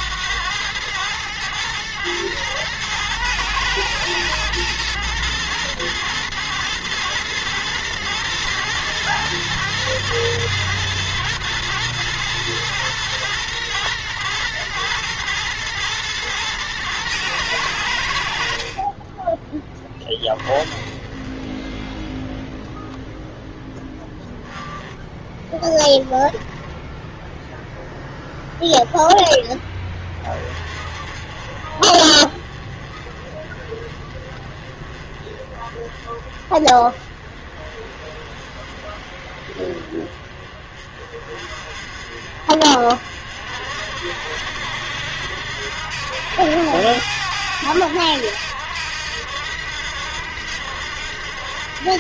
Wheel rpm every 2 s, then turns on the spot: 100, 110, 110, 110, 110, 110, 110, 110, 110, 40, 30, 10, 10, 10, 0, 30, 30, 30, 30, 30, 30, 50, 70, 80, 80, 80.
none